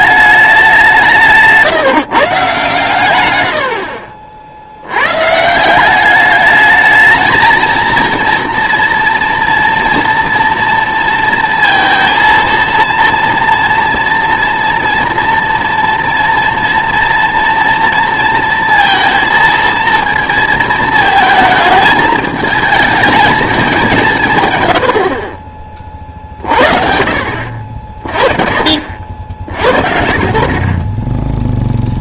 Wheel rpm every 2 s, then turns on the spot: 190, 140, 70, 210, 230, 230, 230, 230, 230, 230, 220, 220, 100, 50, 60, 40.
none